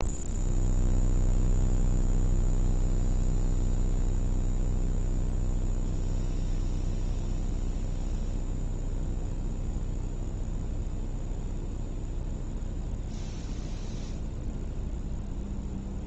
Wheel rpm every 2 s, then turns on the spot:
0, 0, 0, 0, 0, 0, 0, 0.
none